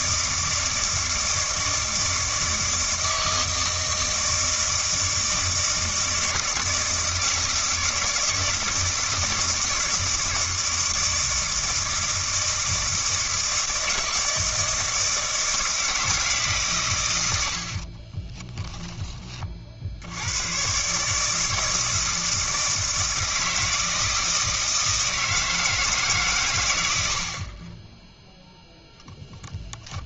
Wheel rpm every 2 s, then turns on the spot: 160, 160, 160, 160, 160, 160, 160, 160, 130, 20, 120, 160, 160, 100, 0.
18-20